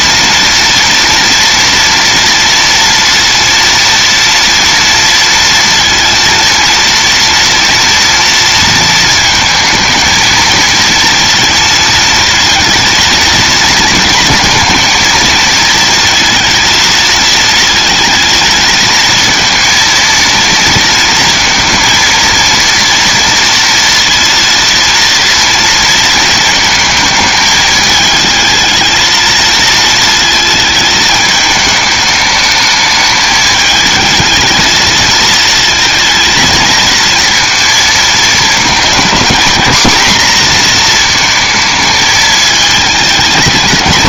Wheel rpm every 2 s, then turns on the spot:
230, 230, 230, 230, 230, 230, 230, 230, 230, 230, 230, 230, 230, 220, 220, 220, 210, 220, 230, 220, 230, 220.
none